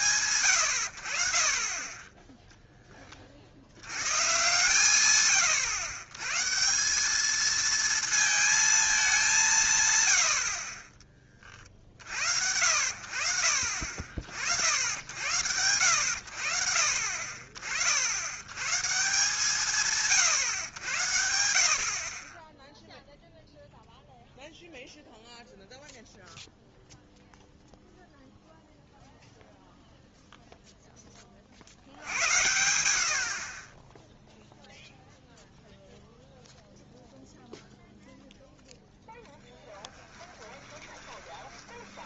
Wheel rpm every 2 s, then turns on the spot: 100, 0, 130, 150, 220, 50, 70, 70, 70, 120, 110, 10, 0, 0, 0, 0, 80, 0, 0, 0, 20.
40-42